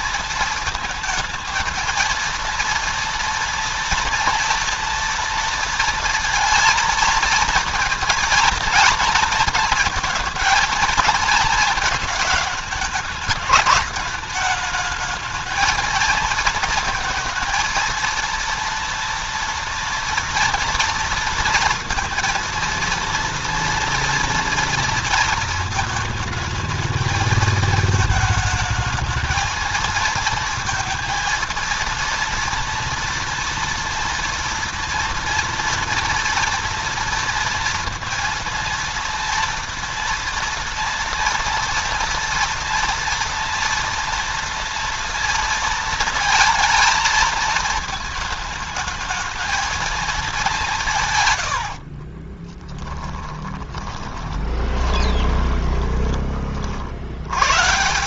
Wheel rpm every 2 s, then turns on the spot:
230, 230, 230, 230, 230, 220, 210, 210, 220, 230, 230, 230, 230, 220, 220, 220, 230, 240, 230, 230, 230, 230, 230, 230, 220, 190, 20, 20, 50.
52-56